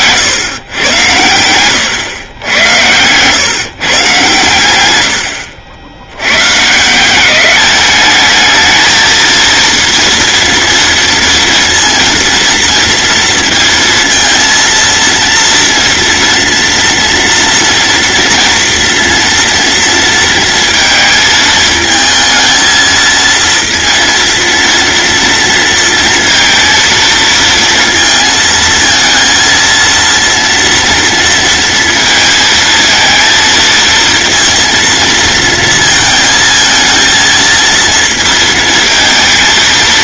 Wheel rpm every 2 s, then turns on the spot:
110, 110, 100, 150, 220, 230, 230, 230, 230, 230, 230, 230, 240, 230, 220, 230, 230, 230, 220, 220.
none